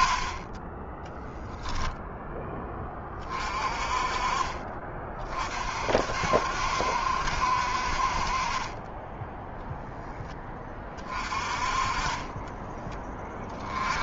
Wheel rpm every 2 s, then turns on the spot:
30, 10, 30, 60, 50, 10, 20.
12-14